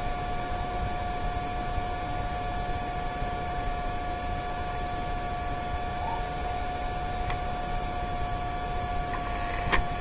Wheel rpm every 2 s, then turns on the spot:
0, 0, 0, 0, 0.
none